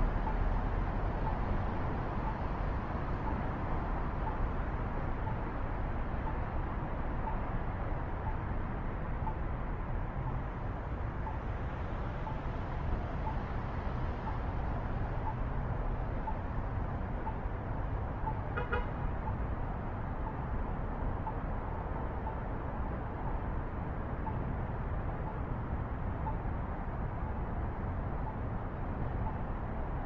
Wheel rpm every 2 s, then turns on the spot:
0, 0, 0, 0, 0, 0, 0, 0, 0, 0, 0, 0, 0, 0, 0.
none